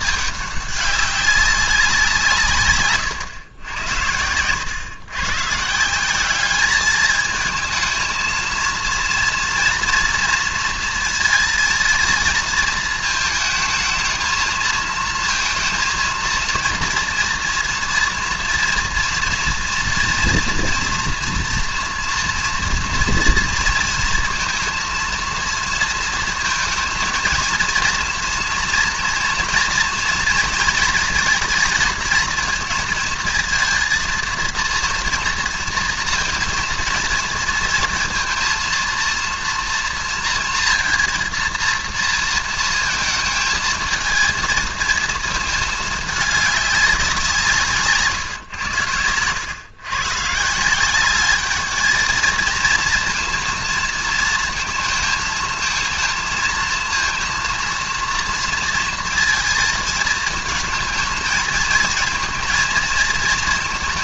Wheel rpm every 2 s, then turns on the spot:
200, 140, 100, 210, 230, 230, 220, 220, 230, 230, 230, 230, 230, 230, 240, 230, 220, 230, 230, 230, 230, 230, 220, 200, 100, 170, 230, 220, 230, 230, 220, 230.
none